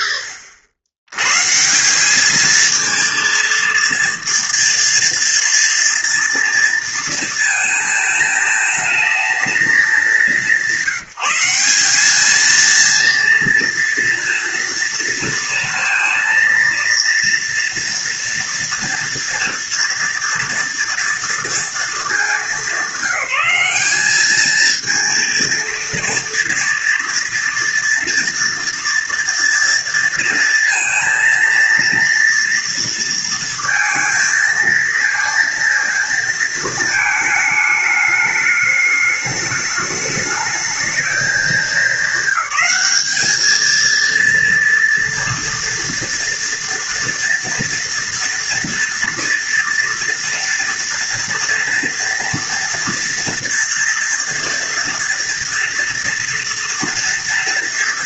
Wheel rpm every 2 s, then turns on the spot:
90, 230, 230, 230, 220, 190, 230, 230, 230, 230, 230, 190, 230, 240, 230, 230, 230, 230, 220, 210, 210, 210, 240, 230, 230, 230, 230, 230, 240.
none